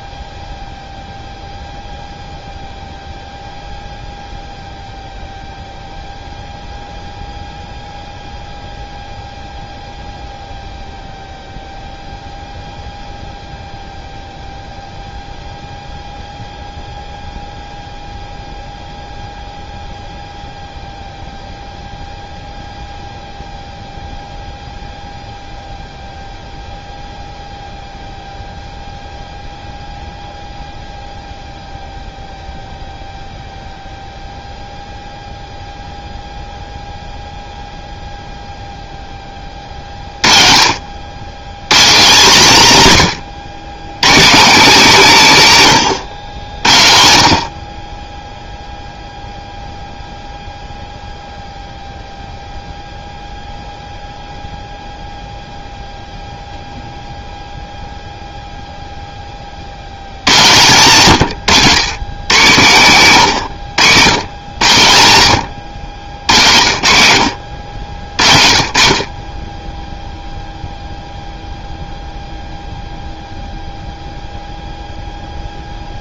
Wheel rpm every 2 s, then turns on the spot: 0, 0, 0, 0, 0, 0, 0, 0, 0, 0, 0, 0, 0, 0, 0, 0, 0, 0, 0, 10, 70, 150, 200, 70, 0, 0, 0, 0, 0, 10, 130, 130, 110, 80, 40, 0, 0, 0.
none